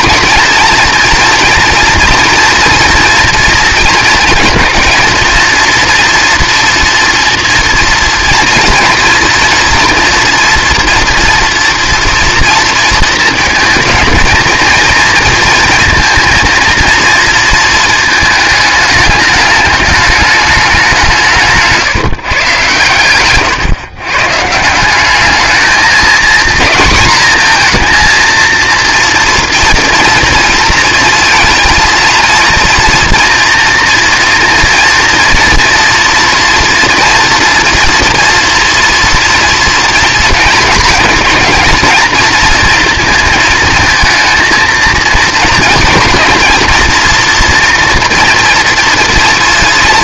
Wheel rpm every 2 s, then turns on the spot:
220, 230, 220, 240, 240, 230, 230, 220, 230, 210, 200, 130, 160, 230, 230, 230, 230, 240, 240, 240, 230, 220, 220, 230, 230.
none